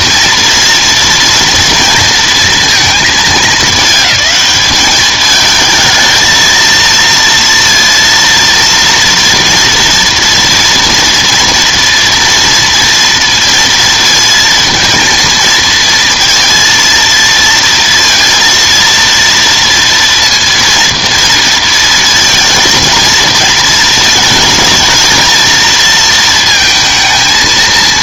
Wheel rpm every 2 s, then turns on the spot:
230, 220, 210, 220, 230, 230, 230, 230, 230, 230, 240, 230, 220, 230.
none